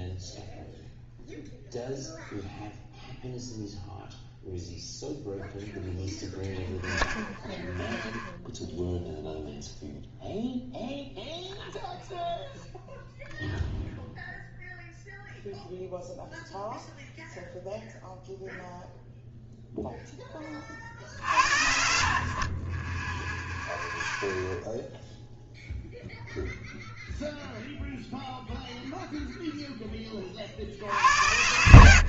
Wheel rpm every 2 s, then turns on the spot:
0, 0, 0, 0, 0, 0, 0, 0, 0, 0, 30, 30, 0, 0, 0, 60.
none